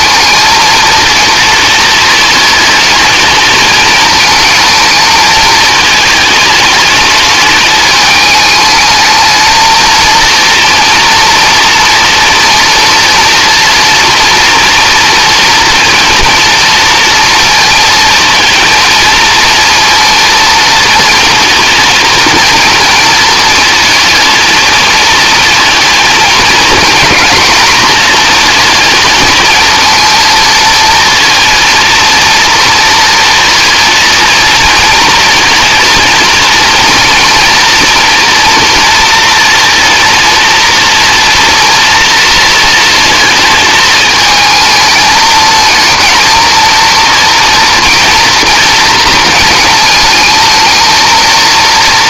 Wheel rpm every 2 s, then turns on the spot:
230, 220, 220, 210, 220, 230, 240, 240, 230, 230, 230, 230, 220, 220, 220, 230, 230, 230, 230, 230, 230, 230, 220, 230, 230, 230.
none